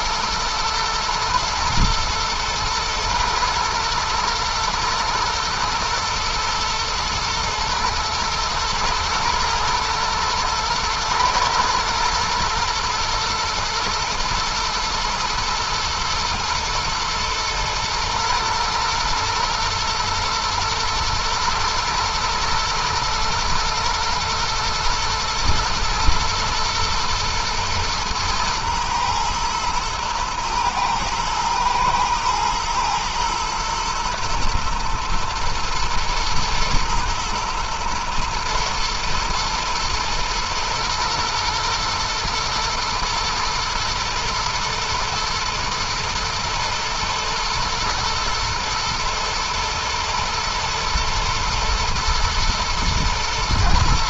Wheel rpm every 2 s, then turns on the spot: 110, 110, 120, 110, 110, 110, 120, 120, 110, 120, 110, 120, 110, 110, 110, 110, 110, 120, 110, 120, 120, 110, 120, 120, 110, 120, 120.
none